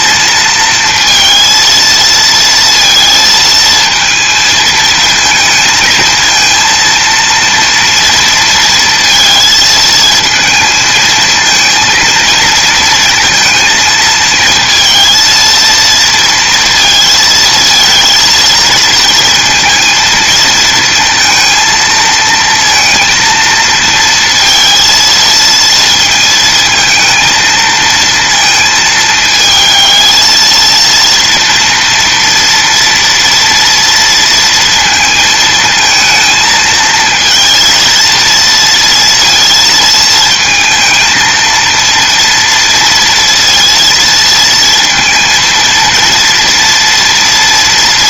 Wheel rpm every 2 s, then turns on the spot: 230, 230, 220, 230, 230, 220, 230, 220, 230, 230, 230, 230, 230, 220, 220, 230, 230, 230, 220, 230, 230, 230, 230, 230.
none